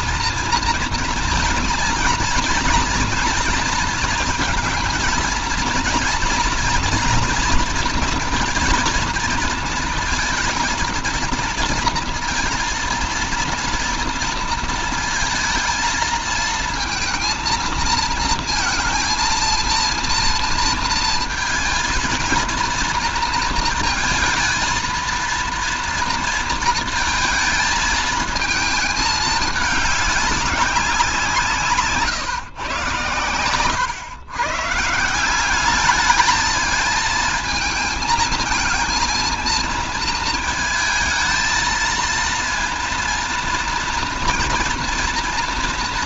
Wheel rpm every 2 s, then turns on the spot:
230, 240, 230, 240, 230, 230, 230, 230, 230, 230, 230, 230, 230, 230, 220, 200, 130, 130, 220, 220, 220, 230, 230.
none